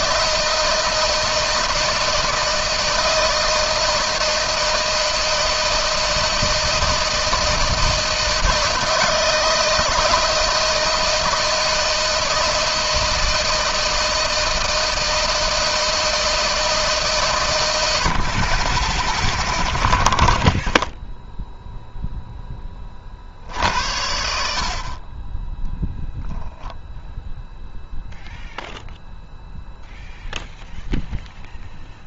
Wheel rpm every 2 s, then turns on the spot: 160, 160, 160, 160, 160, 160, 160, 160, 160, 40, 0, 10, 60, 0, 0, 0.
none